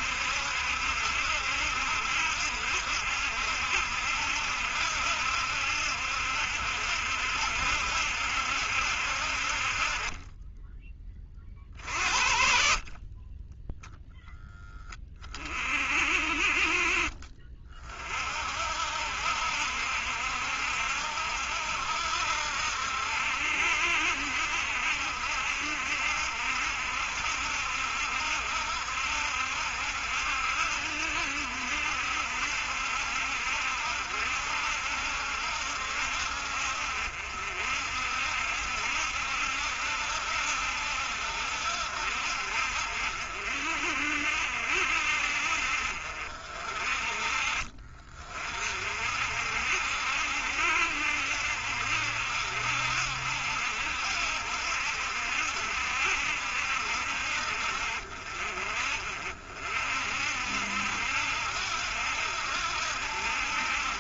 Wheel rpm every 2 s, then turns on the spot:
70, 70, 70, 70, 70, 20, 60, 0, 40, 50, 70, 70, 70, 70, 70, 70, 70, 70, 60, 60, 70, 60, 60, 50, 40, 70, 70, 70, 70, 50, 60, 70.
none